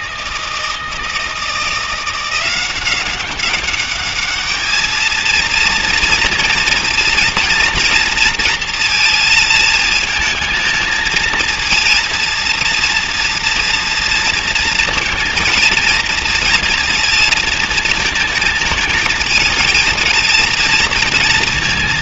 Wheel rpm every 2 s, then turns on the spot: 160, 180, 210, 230, 230, 220, 230, 230, 230, 220, 220.
none